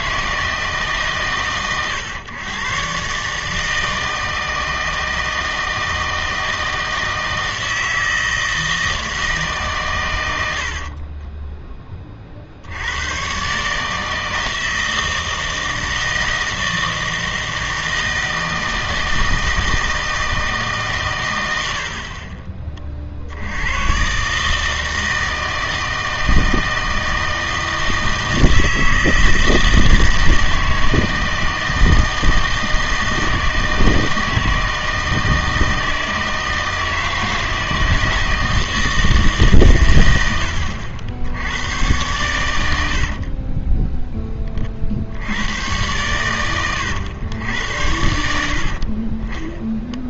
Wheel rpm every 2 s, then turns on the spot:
140, 120, 160, 160, 160, 80, 70, 160, 160, 160, 150, 40, 160, 160, 160, 160, 160, 160, 160, 160, 70, 90, 40, 110, 70.
10-12